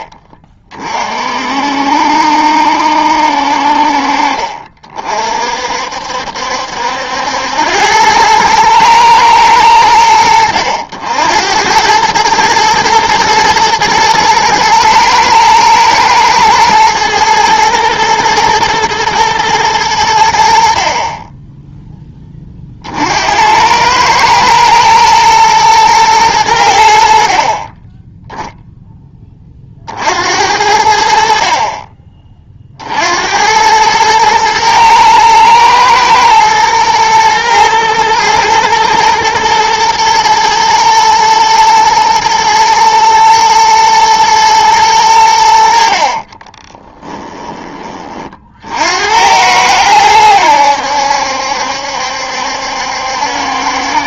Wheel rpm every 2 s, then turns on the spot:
30, 70, 40, 70, 110, 80, 110, 110, 110, 110, 60, 40, 110, 90, 0, 70, 50, 110, 110, 120, 110, 120, 110, 40, 50, 90, 70.
46-48